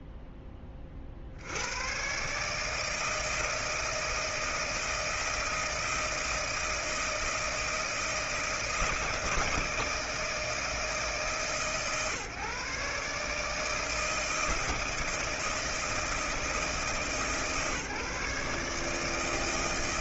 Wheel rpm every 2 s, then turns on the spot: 70, 160, 160, 160, 160, 150, 150, 160, 150, 160.
none